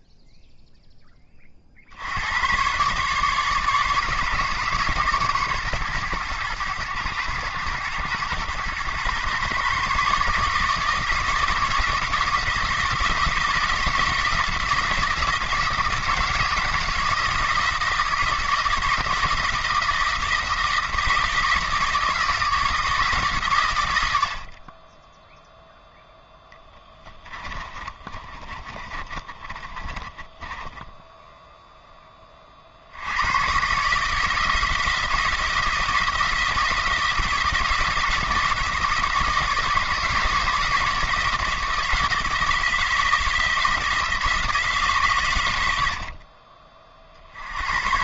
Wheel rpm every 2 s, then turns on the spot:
10, 130, 140, 100, 110, 160, 160, 170, 160, 160, 160, 160, 30, 10, 30, 10, 60, 160, 160, 160, 160, 160, 160, 40.
26-32